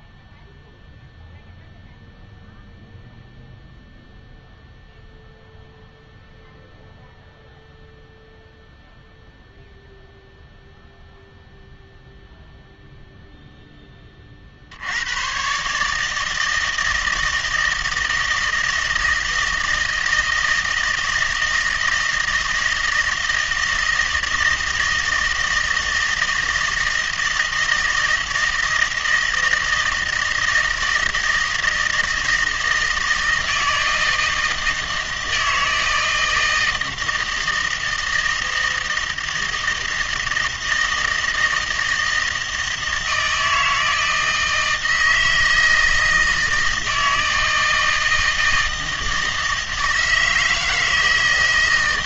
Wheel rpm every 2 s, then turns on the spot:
0, 0, 0, 0, 0, 0, 0, 70, 160, 160, 160, 160, 160, 160, 160, 160, 160, 160, 160, 160, 160, 160, 160, 160, 160, 160.
none